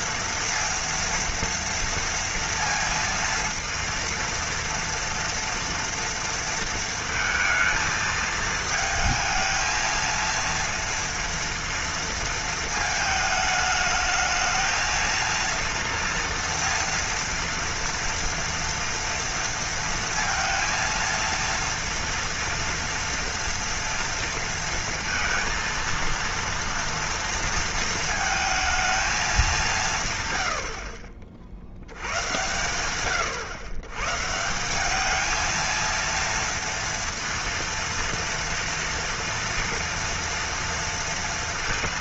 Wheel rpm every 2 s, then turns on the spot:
230, 230, 230, 230, 220, 230, 230, 220, 230, 230, 230, 230, 230, 230, 220, 100, 110, 160, 230, 230, 230.
none